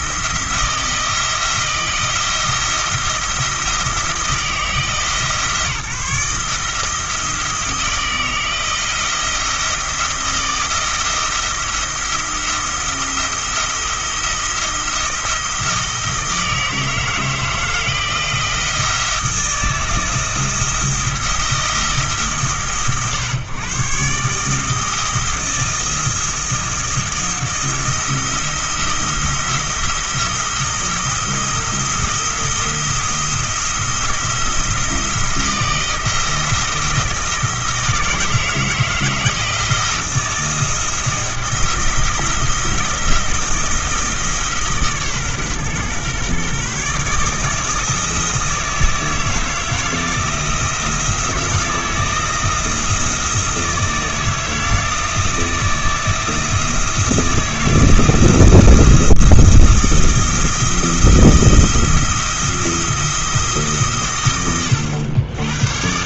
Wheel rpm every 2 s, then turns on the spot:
170, 170, 160, 160, 170, 170, 170, 170, 160, 160, 170, 130, 160, 160, 170, 170, 170, 160, 170, 170, 170, 170, 140, 140, 160, 170, 170, 160, 160, 170, 170, 170, 80.
64-66